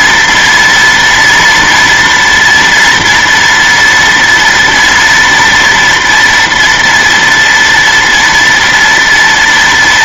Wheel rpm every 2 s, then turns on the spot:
240, 240, 230, 230, 230.
none